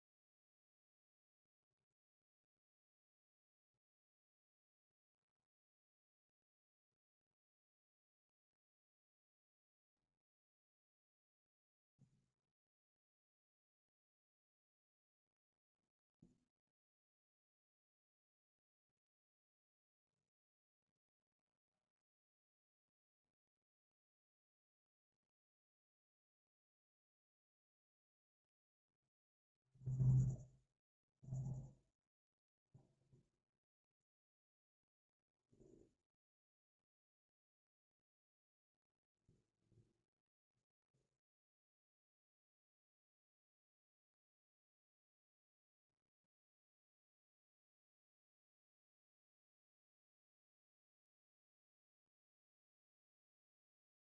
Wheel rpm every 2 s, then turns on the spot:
0, 0, 0, 0, 0, 0, 0, 0, 0, 0, 0, 0, 0, 0, 0, 0, 0, 0, 0, 0, 0, 0, 0, 0, 0, 0, 0.
none